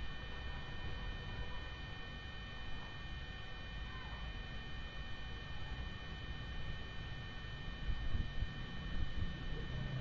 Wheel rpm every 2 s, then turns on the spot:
0, 0, 0, 0, 0.
none